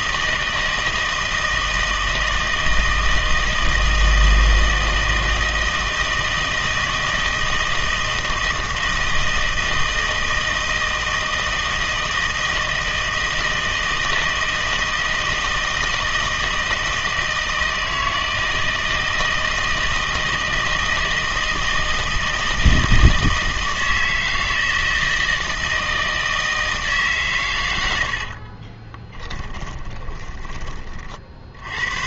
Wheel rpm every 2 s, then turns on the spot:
160, 160, 160, 160, 160, 160, 160, 160, 160, 160, 160, 160, 160, 160, 30, 30.
28-30